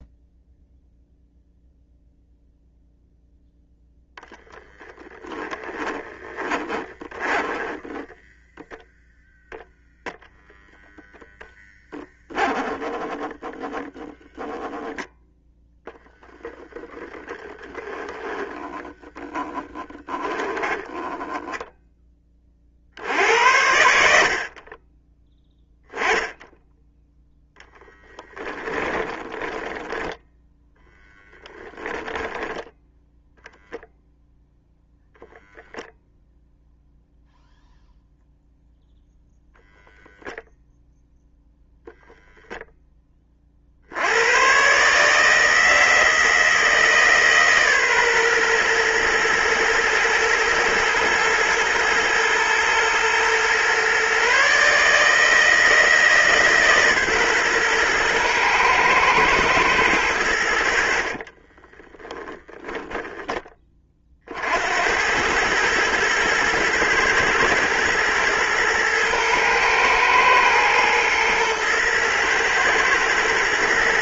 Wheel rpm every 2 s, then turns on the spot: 0, 0, 10, 20, 0, 0, 10, 10, 10, 10, 10, 40, 40, 10, 10, 0, 0, 0, 0, 0, 0, 0, 120, 160, 120, 110, 110, 140, 150, 120, 70, 0, 80, 110, 110, 120, 120.
6-8 18-22 28-30 60-62